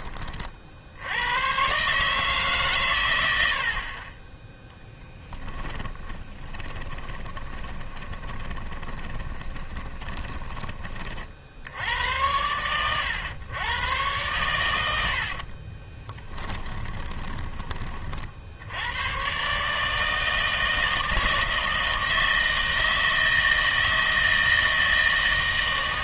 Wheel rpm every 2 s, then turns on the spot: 70, 130, 10, 20, 20, 30, 100, 90, 20, 80, 160, 160, 160.
4-10 14-18